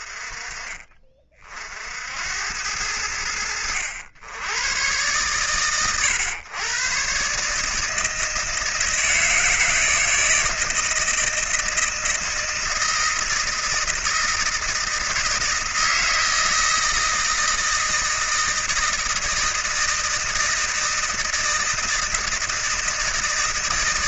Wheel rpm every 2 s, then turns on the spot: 40, 80, 110, 140, 160, 160, 170, 160, 160, 160, 160, 160.
none